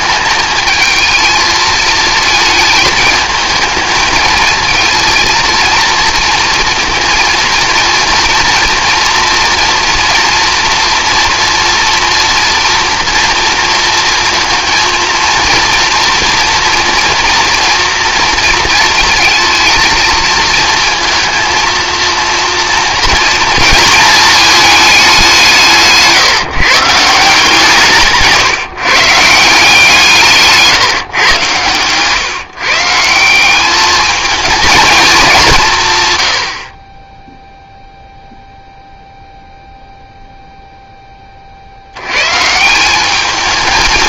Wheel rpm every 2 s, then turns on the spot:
220, 220, 220, 230, 230, 230, 240, 230, 240, 230, 220, 230, 220, 160, 150, 150, 140, 220, 70, 0, 0, 160.
none